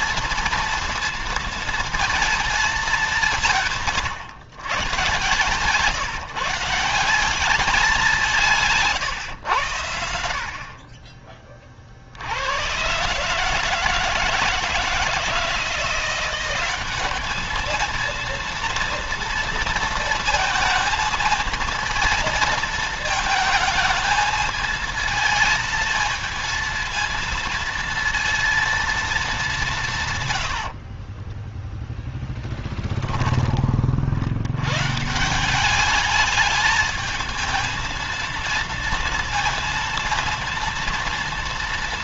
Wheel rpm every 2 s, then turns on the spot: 230, 200, 120, 170, 140, 40, 120, 160, 200, 230, 220, 220, 220, 230, 230, 40, 10, 120, 220, 230, 230.
30-32